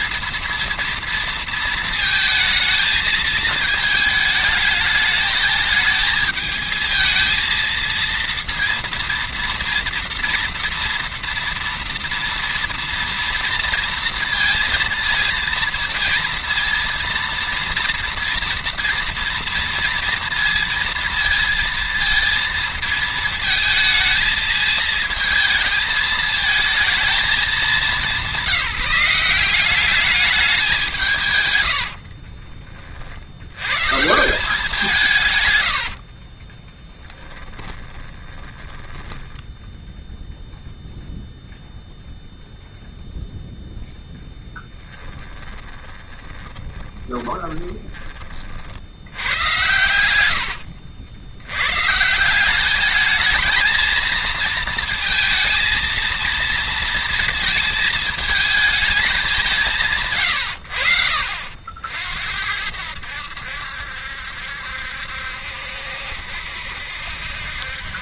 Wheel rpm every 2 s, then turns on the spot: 230, 220, 210, 220, 230, 230, 230, 230, 230, 230, 230, 220, 220, 220, 190, 180, 40, 160, 10, 10, 0, 0, 10, 20, 80, 90, 200, 230, 230, 210, 70, 70, 70, 70.
36-38 44-48